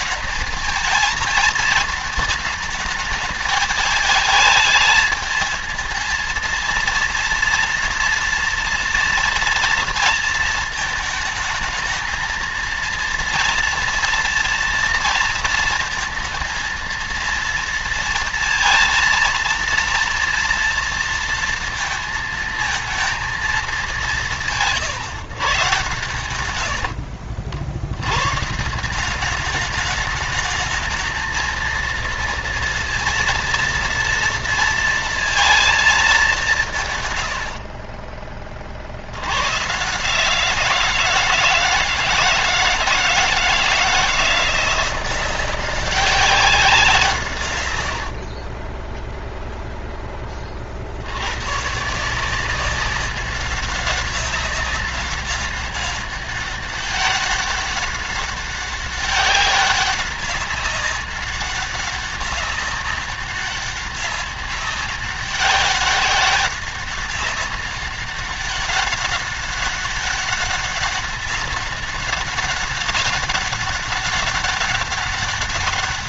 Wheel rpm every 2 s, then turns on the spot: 220, 220, 220, 230, 230, 220, 230, 230, 230, 230, 230, 220, 170, 70, 160, 220, 230, 230, 150, 60, 170, 160, 180, 180, 10, 60, 190, 190, 200, 200, 200, 200, 200, 200, 200, 200, 200, 200.
26-28 48-50